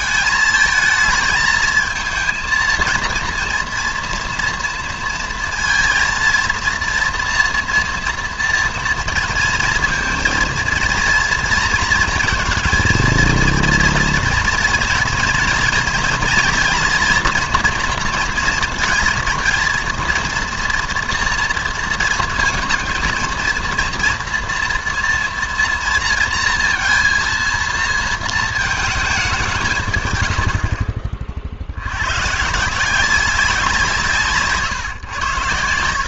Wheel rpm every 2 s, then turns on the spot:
220, 220, 230, 230, 230, 230, 230, 230, 230, 230, 230, 230, 230, 230, 220, 60, 160, 140.
none